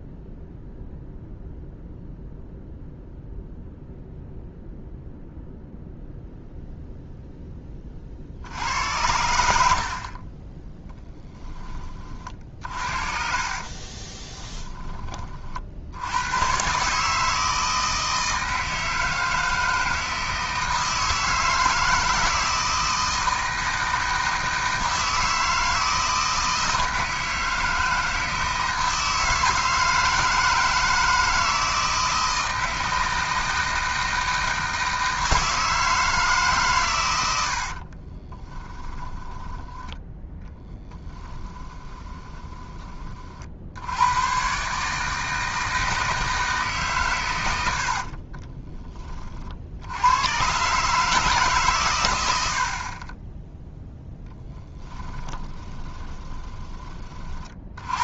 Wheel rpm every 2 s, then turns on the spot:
0, 0, 0, 0, 80, 10, 40, 10, 140, 160, 160, 160, 160, 160, 160, 160, 160, 160, 130, 20, 10, 20, 150, 150, 20, 140, 60, 10, 20.
12-14 38-42 48-50 54-56